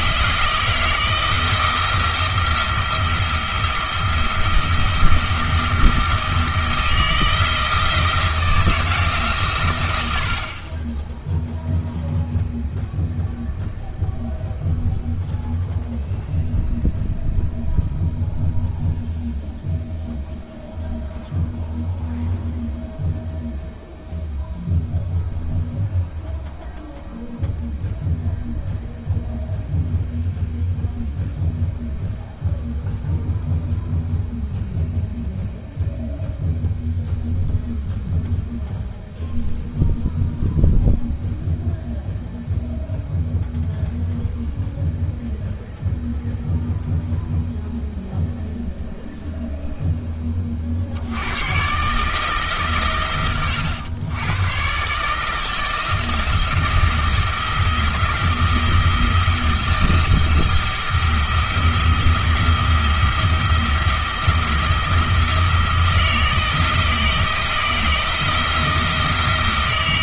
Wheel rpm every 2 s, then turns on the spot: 160, 170, 170, 160, 160, 30, 0, 0, 0, 0, 0, 0, 0, 0, 0, 0, 0, 0, 0, 0, 0, 0, 0, 0, 0, 50, 130, 130, 170, 170, 170, 170, 170, 160, 160.
none